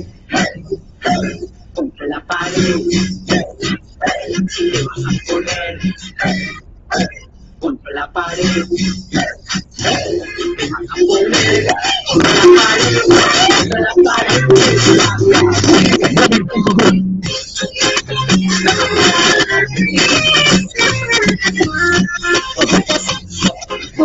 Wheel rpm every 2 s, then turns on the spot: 0, 0, 0, 0, 0, 0, 0, 0, 0, 0, 0, 0.
none